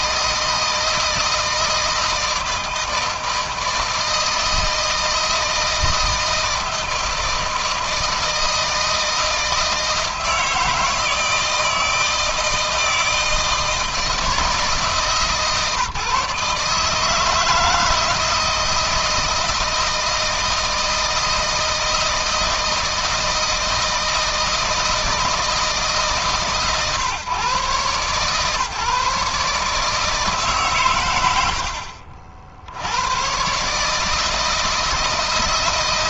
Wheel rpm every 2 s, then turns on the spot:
160, 160, 160, 160, 160, 160, 160, 160, 150, 160, 160, 160, 160, 140, 140, 140, 70, 160.
none